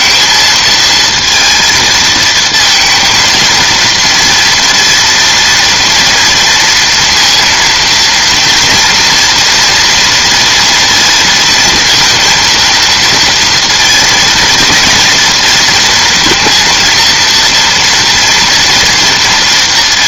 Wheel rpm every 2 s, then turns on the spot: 220, 230, 230, 230, 230, 230, 230, 230, 230, 230.
none